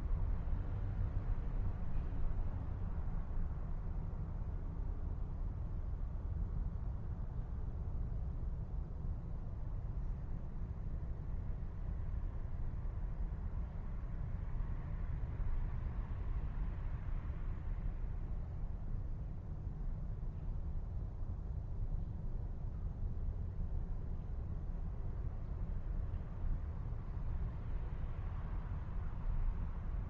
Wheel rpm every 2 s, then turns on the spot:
0, 0, 0, 0, 0, 0, 0, 0, 0, 0, 0, 0, 0, 0, 0.
none